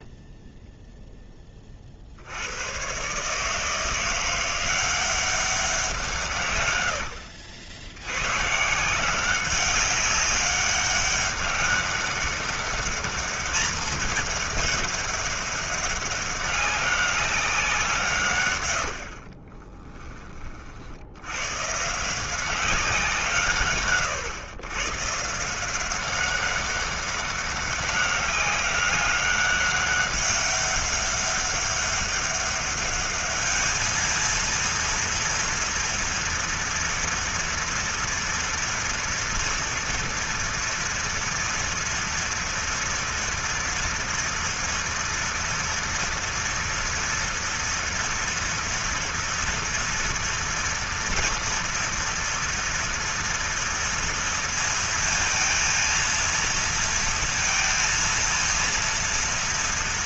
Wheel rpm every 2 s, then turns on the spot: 0, 110, 180, 80, 160, 200, 200, 200, 200, 80, 60, 180, 140, 200, 200, 200, 200, 230, 230, 230, 230, 230, 230, 230, 240, 240, 230, 230, 230, 230.
18-20